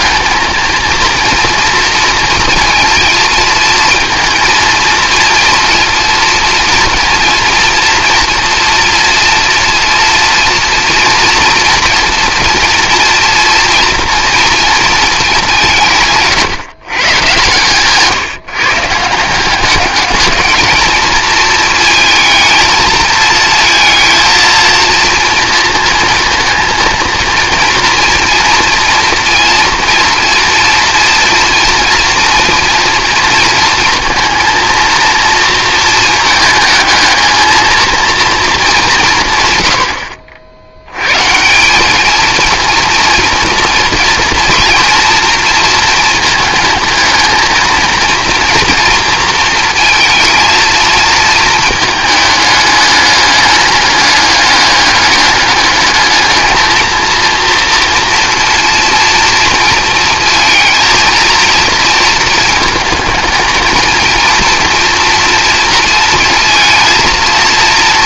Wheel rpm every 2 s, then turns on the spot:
230, 230, 230, 230, 230, 230, 230, 230, 130, 150, 220, 220, 230, 230, 230, 230, 230, 230, 220, 190, 100, 230, 230, 220, 240, 220, 210, 200, 220, 240, 230, 220, 230, 230.
none